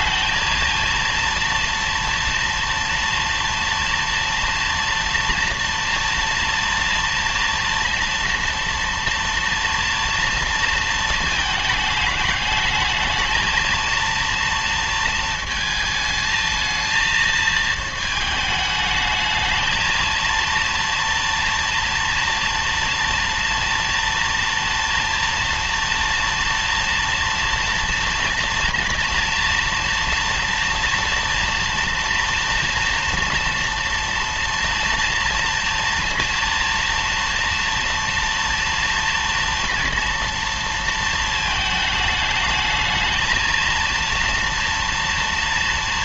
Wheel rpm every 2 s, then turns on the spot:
230, 230, 230, 230, 230, 230, 210, 230, 220, 220, 230, 230, 230, 230, 230, 230, 240, 230, 230, 230, 230, 220, 230.
none